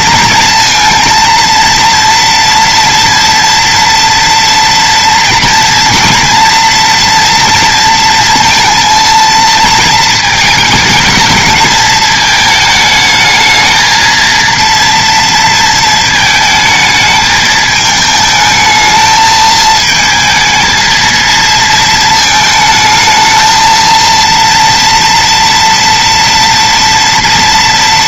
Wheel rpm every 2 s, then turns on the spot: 230, 230, 240, 230, 230, 220, 220, 230, 220, 220, 220, 220, 230, 230.
none